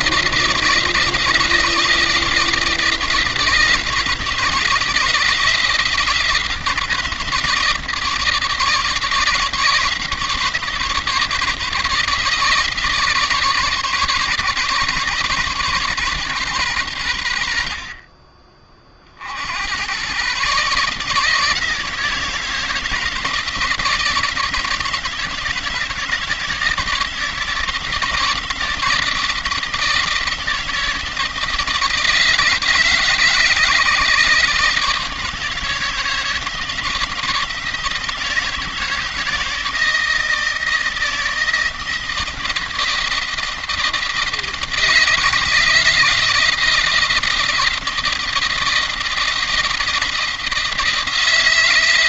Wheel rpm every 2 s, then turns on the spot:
160, 170, 170, 170, 160, 160, 160, 150, 120, 50, 150, 160, 170, 160, 160, 170, 160, 150, 160, 170, 170, 170, 160, 170, 170, 160.
none